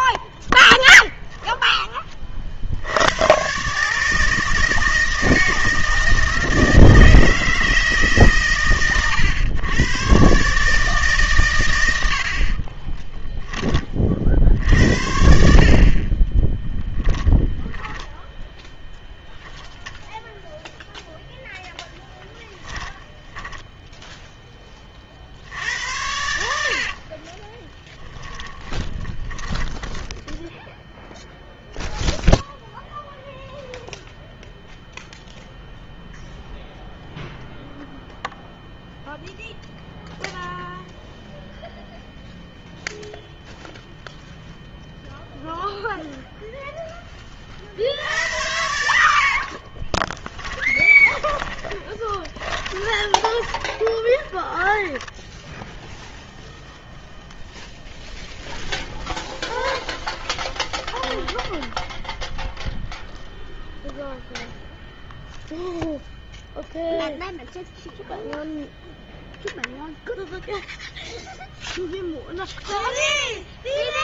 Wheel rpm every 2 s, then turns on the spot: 0, 70, 160, 160, 120, 140, 30, 60, 10, 0, 0, 10, 20, 60, 10, 0, 0, 0, 0, 0, 0, 0, 0, 0, 80, 10, 20, 10, 0, 0, 0, 0, 0, 0, 0, 0, 0.
12-14 22-24 28-30 50-56